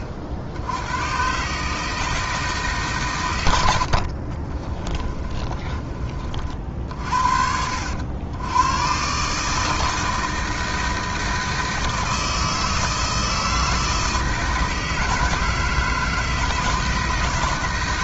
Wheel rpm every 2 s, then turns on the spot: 60, 140, 30, 50, 110, 160, 160, 160, 160.
4-6